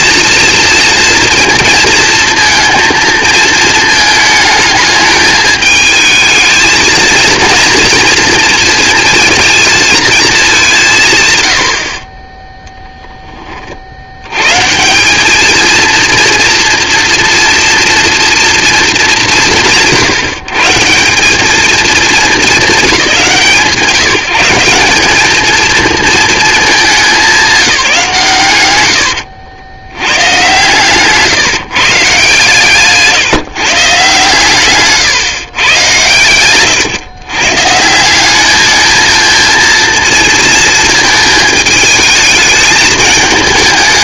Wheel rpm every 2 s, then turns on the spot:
230, 220, 210, 230, 230, 60, 40, 230, 230, 180, 220, 170, 220, 180, 70, 150, 140, 130, 130, 230, 220, 220.
none